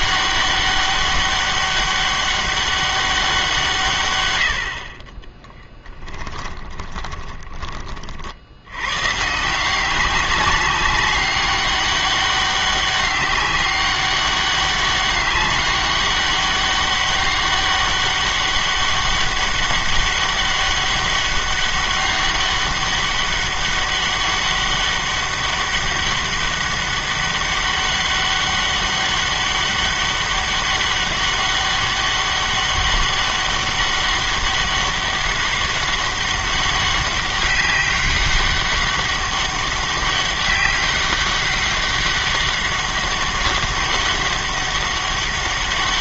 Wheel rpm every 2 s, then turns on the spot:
200, 200, 70, 20, 90, 200, 200, 200, 200, 200, 200, 200, 200, 200, 200, 200, 200, 200, 200, 200, 200, 200, 200.
6-8